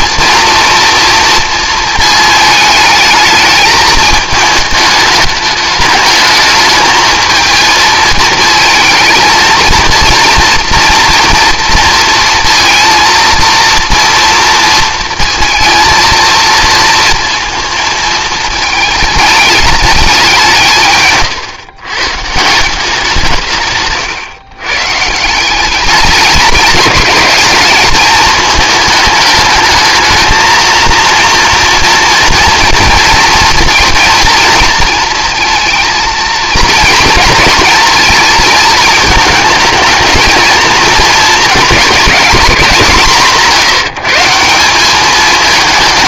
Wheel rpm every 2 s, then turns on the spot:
230, 220, 210, 210, 220, 230, 230, 230, 230, 220, 150, 180, 140, 200, 220, 230, 230, 230, 230, 220, 220, 180, 190.
none